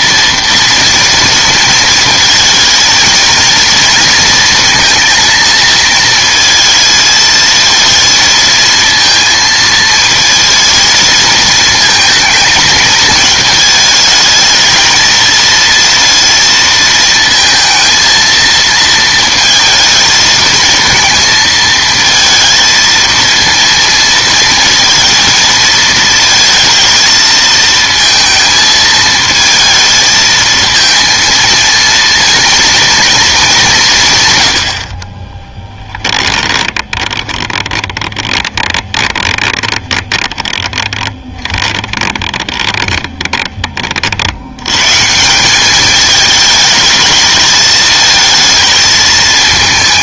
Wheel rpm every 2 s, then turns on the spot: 230, 230, 230, 220, 230, 230, 220, 220, 230, 230, 220, 220, 230, 220, 220, 230, 230, 80, 20, 20, 20, 30, 110, 210, 220.
36-44